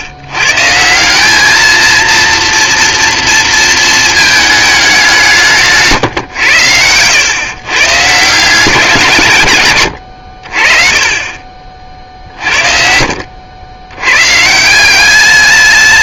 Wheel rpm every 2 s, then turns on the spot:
140, 230, 210, 100, 180, 50, 50, 160.
none